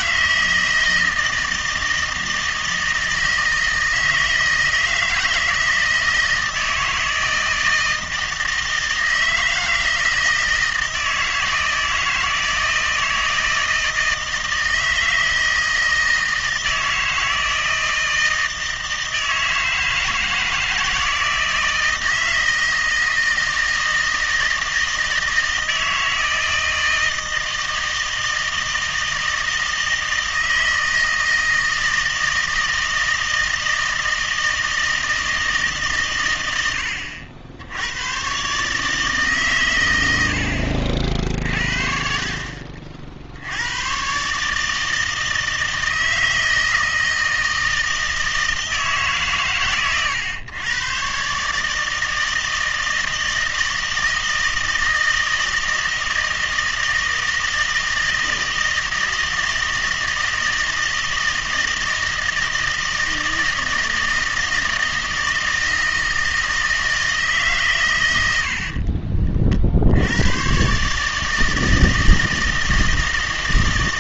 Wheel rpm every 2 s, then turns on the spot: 160, 160, 160, 160, 160, 160, 160, 160, 160, 160, 160, 160, 160, 160, 160, 160, 160, 160, 90, 140, 70, 50, 150, 160, 160, 120, 160, 160, 160, 160, 160, 160, 160, 160, 70, 130, 160.
none